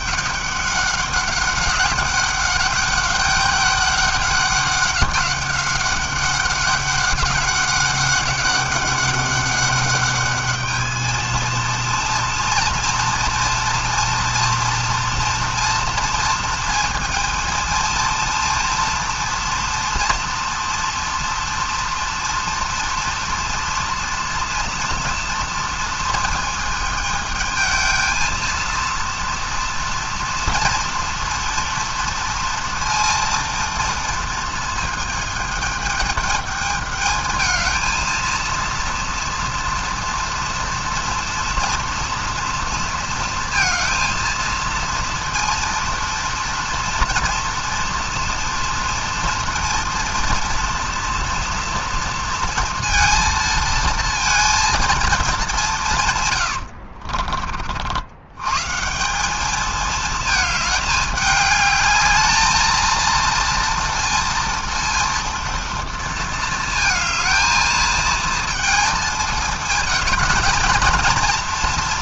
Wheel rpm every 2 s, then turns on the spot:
200, 200, 200, 200, 200, 210, 230, 230, 230, 230, 230, 230, 230, 220, 230, 230, 230, 230, 210, 230, 230, 230, 230, 230, 230, 230, 230, 230, 70, 150, 210, 220, 230, 220, 220, 220.
56-58